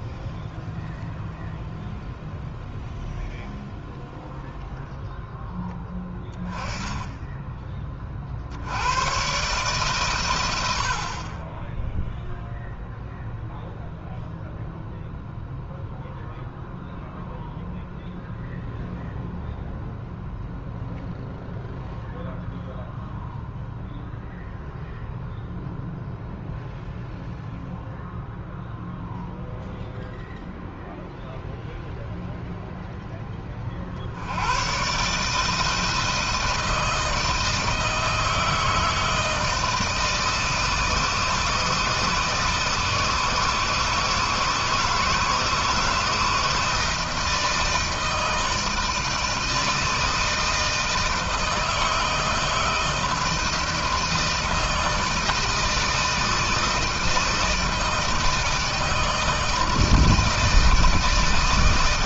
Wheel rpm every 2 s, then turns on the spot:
0, 0, 0, 10, 90, 80, 0, 0, 0, 0, 0, 0, 0, 0, 0, 0, 0, 110, 160, 160, 160, 160, 160, 160, 160, 160, 160, 160, 160, 160, 160.
none